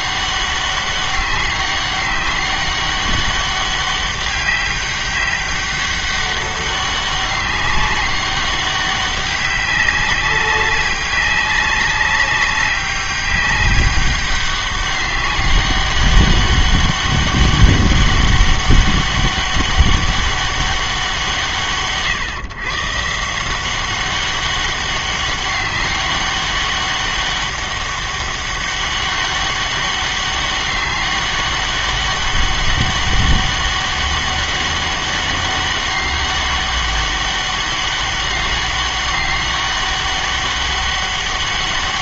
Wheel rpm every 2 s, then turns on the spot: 200, 200, 200, 200, 190, 190, 200, 200, 200, 200, 200, 140, 190, 200, 200, 200, 200, 200, 200, 200, 200.
none